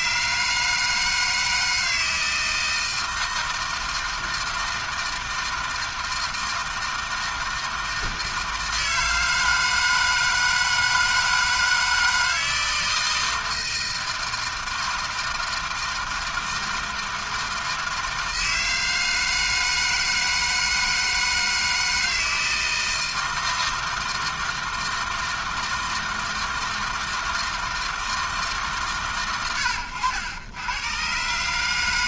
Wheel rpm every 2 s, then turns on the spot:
150, 160, 160, 160, 160, 160, 160, 160, 160, 160, 160, 160, 160, 160, 140, 100.
none